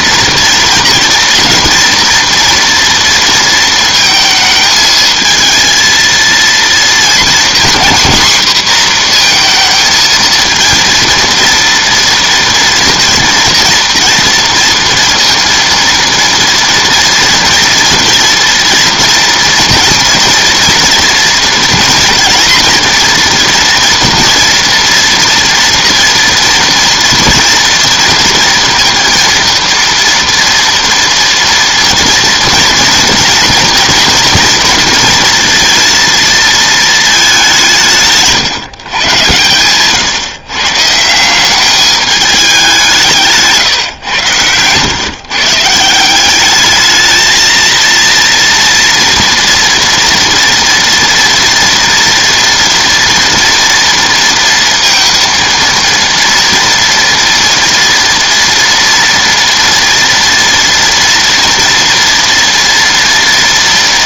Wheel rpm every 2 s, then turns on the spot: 240, 230, 220, 230, 240, 230, 230, 230, 230, 230, 230, 230, 230, 240, 230, 230, 230, 230, 210, 120, 160, 180, 150, 220, 230, 230, 240, 230, 230, 230, 230, 230.
none